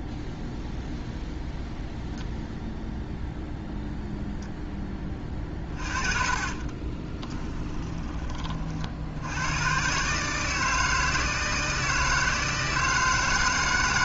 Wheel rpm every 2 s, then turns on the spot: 0, 0, 10, 20, 60, 160, 150.
6-8